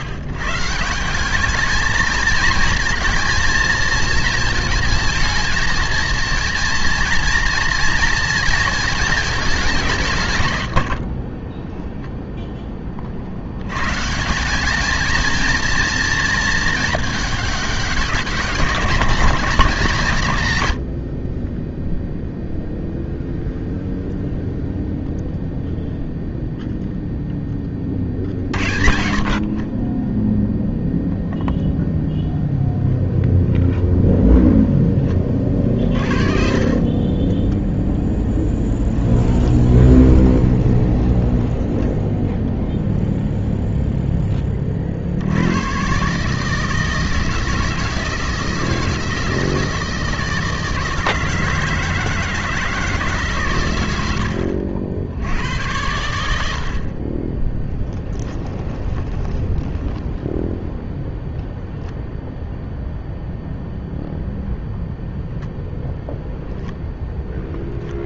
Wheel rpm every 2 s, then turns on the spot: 140, 230, 230, 230, 230, 120, 10, 190, 220, 190, 110, 0, 0, 0, 70, 0, 0, 10, 50, 10, 20, 0, 20, 150, 160, 160, 160, 70, 70, 20, 0, 0, 0, 0.
36-42 54-56 58-60